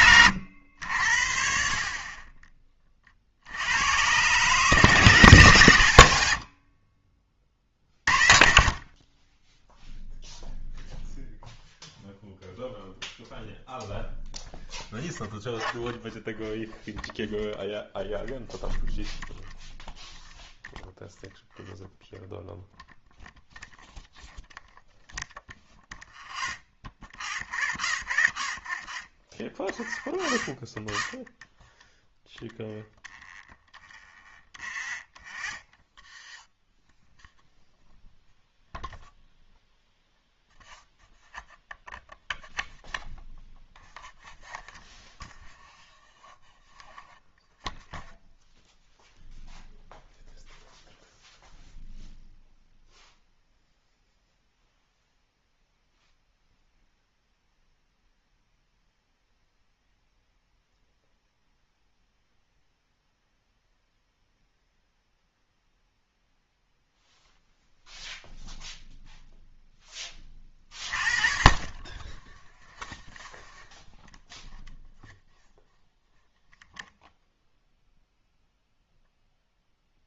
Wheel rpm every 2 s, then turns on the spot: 80, 20, 140, 60, 50, 0, 0, 0, 0, 0, 0, 0, 0, 0, 0, 0, 0, 0, 0, 0, 0, 0, 0, 0, 0, 0, 0, 0, 0, 0, 0, 0, 0, 0, 0, 30, 0, 0, 0, 0.
none